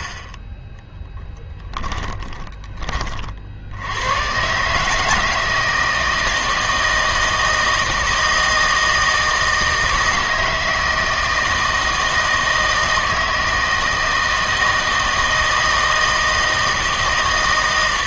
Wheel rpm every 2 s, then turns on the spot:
10, 50, 160, 160, 160, 160, 160, 160, 160.
0-2